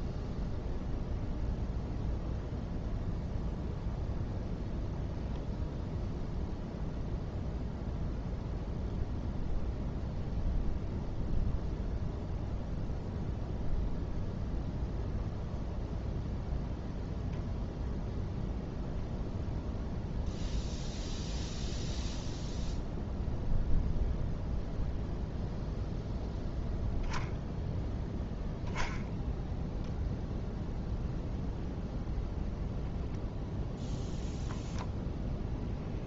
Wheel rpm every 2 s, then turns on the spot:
0, 0, 0, 0, 0, 0, 0, 0, 0, 0, 0, 0, 0, 0, 10, 0, 0, 0.
none